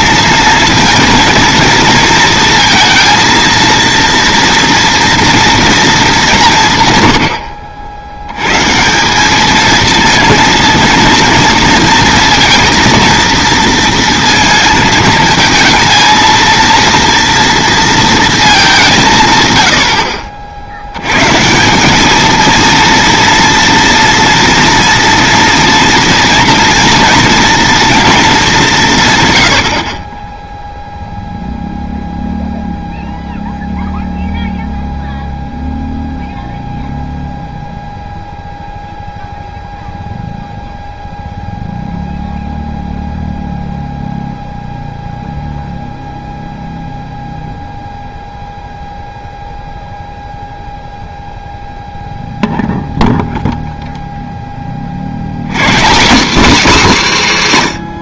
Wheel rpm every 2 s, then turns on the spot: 230, 230, 240, 130, 150, 230, 230, 220, 230, 190, 90, 230, 230, 230, 180, 0, 0, 0, 0, 0, 0, 0, 0, 0, 0, 0, 0, 40, 240.
none